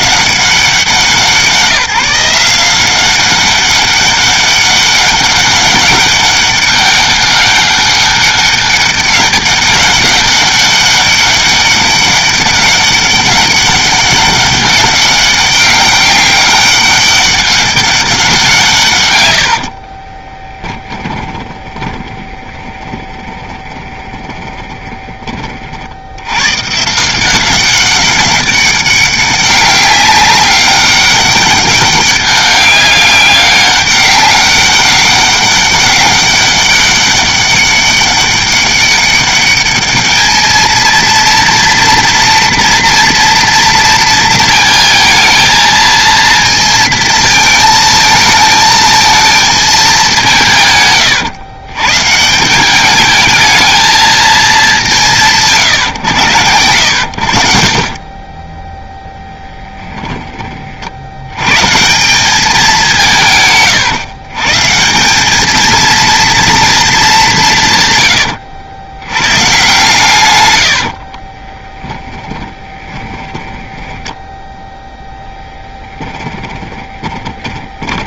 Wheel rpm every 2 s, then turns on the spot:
180, 180, 200, 200, 200, 200, 200, 200, 200, 140, 20, 30, 20, 140, 200, 200, 200, 200, 200, 200, 220, 230, 230, 230, 220, 140, 200, 200, 100, 10, 50, 190, 160, 220, 80, 90, 20, 10, 20.
20-26 58-60 70-74 76-78